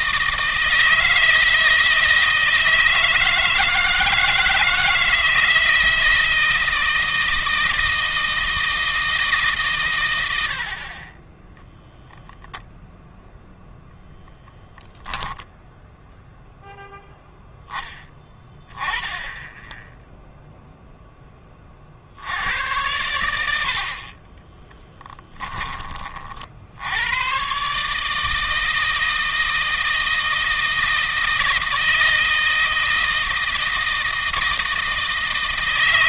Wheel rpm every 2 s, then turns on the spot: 160, 160, 160, 160, 160, 50, 0, 10, 0, 10, 10, 100, 20, 100, 160, 160, 160, 160.
14-16 24-26